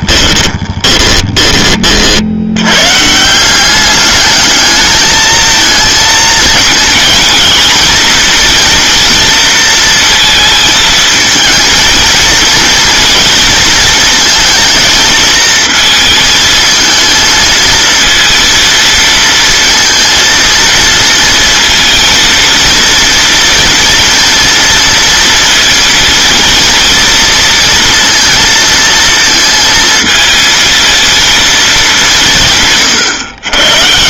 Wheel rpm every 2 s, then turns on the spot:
20, 130, 210, 220, 230, 220, 230, 220, 220, 230, 230, 230, 230, 230, 230, 230, 130.
0-2